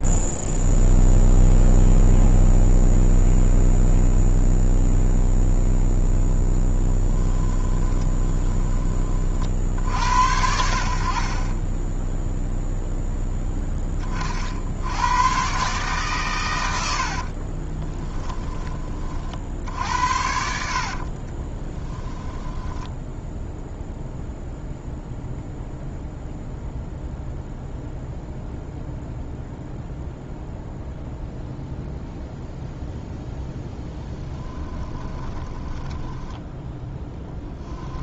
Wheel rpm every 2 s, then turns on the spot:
0, 0, 0, 10, 20, 80, 0, 80, 80, 20, 60, 10, 0, 0, 0, 0, 0, 10, 10.
8-10 20-24 34-38